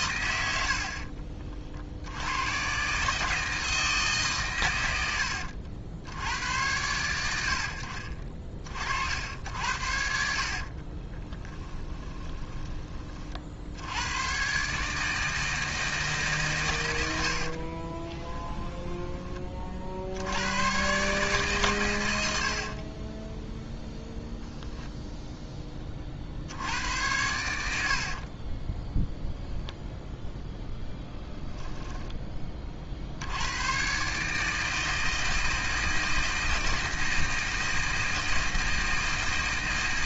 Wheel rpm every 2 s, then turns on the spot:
70, 130, 110, 90, 40, 40, 30, 140, 100, 10, 120, 40, 0, 80, 10, 0, 20, 160, 160, 160.
10-12 18-20 22-24 28-30